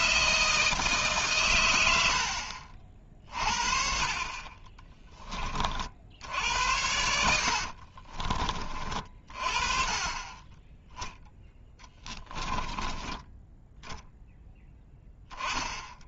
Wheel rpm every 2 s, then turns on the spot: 160, 60, 30, 80, 30, 10, 10, 10.
4-6 12-14